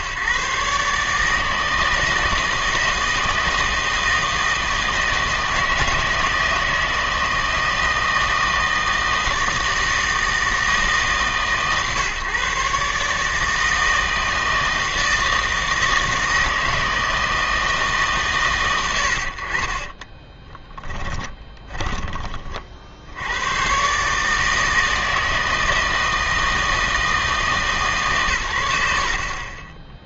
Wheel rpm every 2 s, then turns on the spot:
140, 160, 160, 160, 160, 160, 130, 160, 160, 110, 10, 40, 160, 160, 90.
20-22